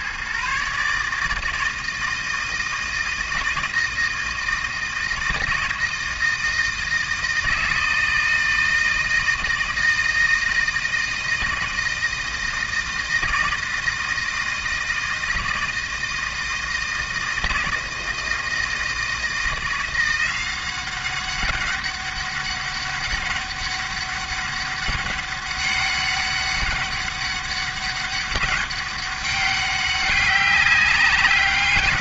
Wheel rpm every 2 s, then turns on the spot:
140, 160, 160, 160, 160, 160, 160, 160, 160, 160, 190, 200, 200, 200, 200, 200.
none